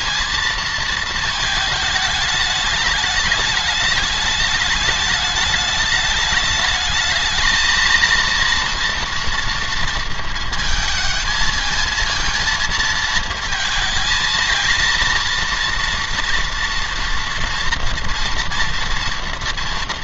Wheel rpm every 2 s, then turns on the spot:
230, 210, 210, 220, 230, 230, 230, 230, 230, 230.
none